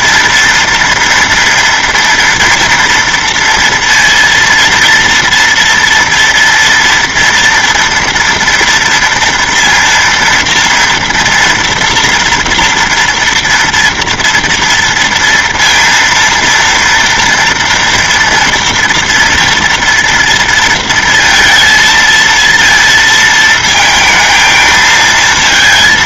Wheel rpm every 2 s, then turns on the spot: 230, 230, 230, 240, 230, 230, 230, 230, 230, 230, 230, 230, 220.
none